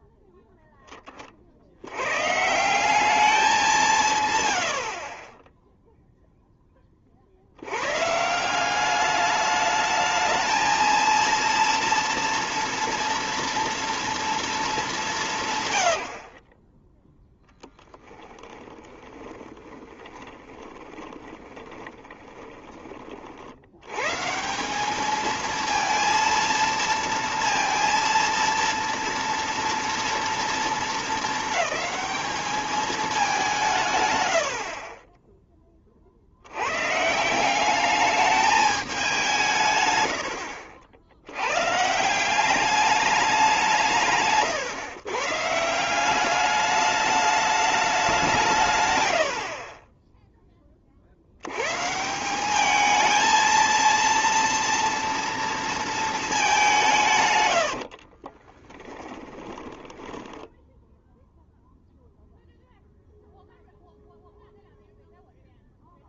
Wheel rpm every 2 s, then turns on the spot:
10, 160, 100, 10, 180, 220, 230, 210, 10, 10, 30, 20, 180, 230, 230, 220, 210, 60, 110, 210, 70, 200, 130, 200, 150, 20, 200, 230, 200, 20, 0, 0, 0.
18-22 34-36 40-42 58-60